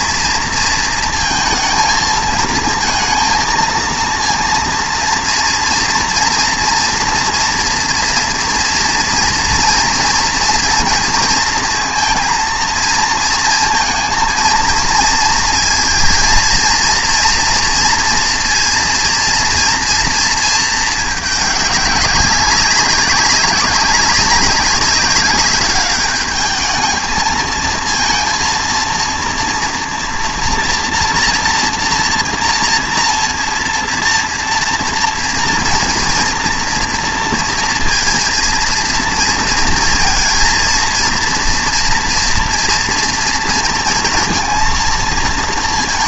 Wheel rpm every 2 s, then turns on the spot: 230, 230, 230, 230, 230, 230, 230, 220, 230, 230, 220, 200, 190, 220, 230, 240, 230, 230, 240, 230, 230, 230, 230.
none